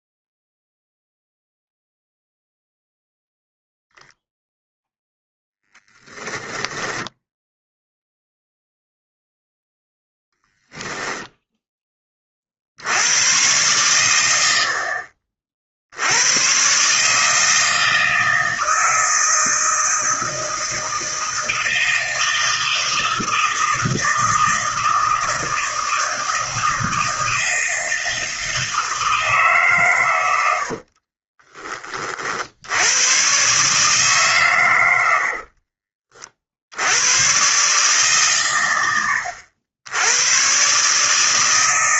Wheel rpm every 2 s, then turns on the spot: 0, 0, 0, 10, 0, 0, 60, 70, 120, 160, 160, 160, 160, 160, 160, 70, 70, 120, 70, 110, 130.
6-8 30-32